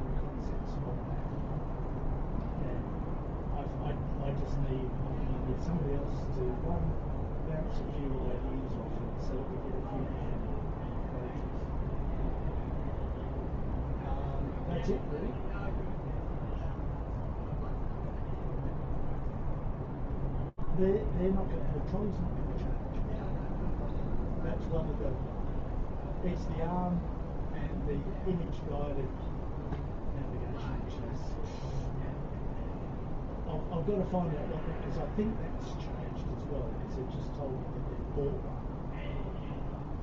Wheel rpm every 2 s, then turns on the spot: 0, 0, 0, 0, 0, 0, 0, 0, 0, 0, 0, 0, 0, 0, 0, 0, 0, 0, 0, 0.
none